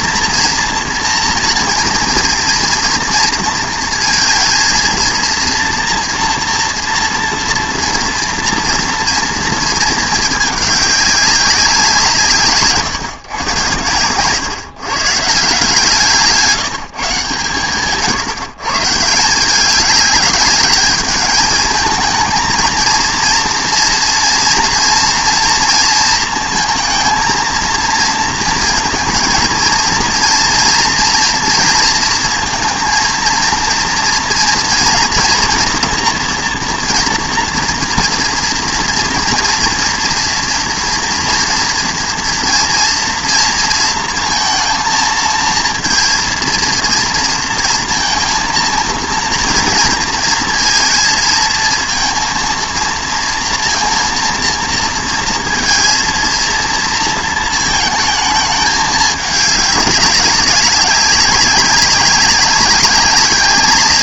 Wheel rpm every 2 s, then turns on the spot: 230, 230, 230, 230, 230, 210, 150, 130, 170, 140, 210, 230, 230, 230, 230, 230, 230, 230, 230, 230, 230, 230, 230, 230, 230, 230, 230, 230, 230, 210, 180, 200.
none